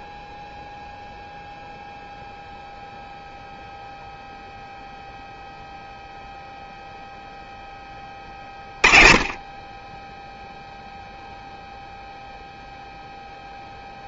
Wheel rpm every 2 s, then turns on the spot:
0, 0, 0, 0, 20, 0, 0.
none